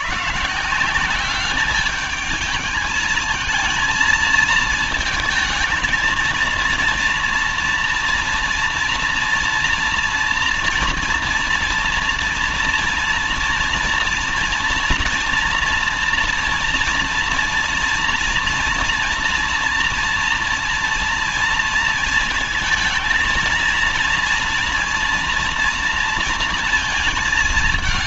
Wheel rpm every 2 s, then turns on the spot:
180, 220, 220, 230, 230, 230, 240, 230, 230, 240, 240, 230, 230, 220.
none